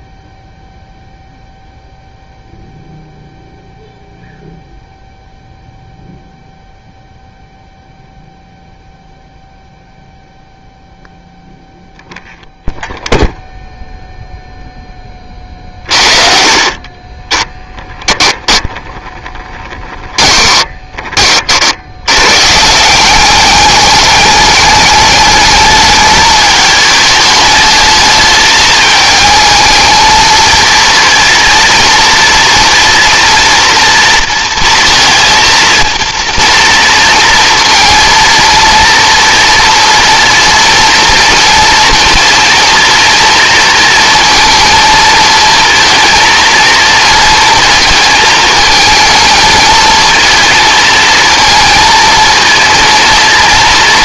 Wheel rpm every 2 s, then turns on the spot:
0, 0, 0, 0, 0, 0, 0, 0, 40, 10, 20, 160, 210, 210, 210, 230, 230, 230, 230, 230, 240, 230, 230, 230, 220, 230, 230.
16-20